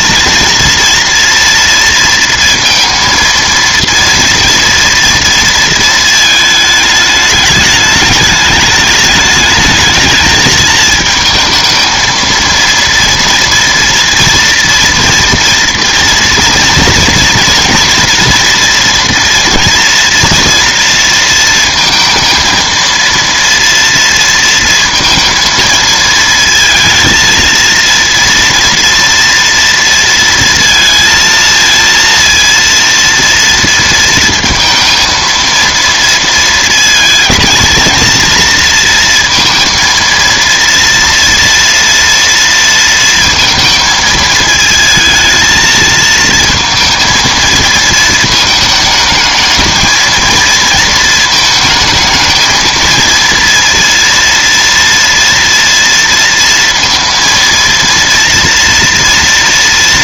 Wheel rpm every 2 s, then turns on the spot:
230, 230, 230, 220, 210, 220, 230, 230, 230, 240, 230, 230, 230, 230, 230, 230, 230, 230, 230, 230, 230, 230, 220, 230, 220, 230, 220, 230, 230, 230.
none